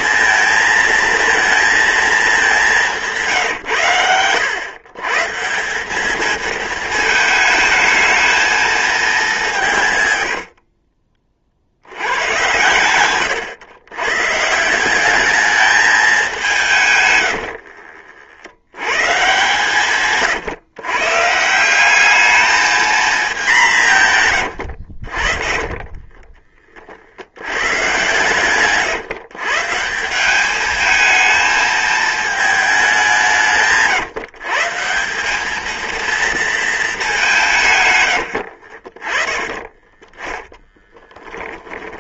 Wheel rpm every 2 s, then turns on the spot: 230, 200, 110, 220, 220, 70, 110, 160, 180, 80, 140, 220, 100, 30, 130, 200, 210, 150, 220, 70, 10.
10-12 24-26 38-42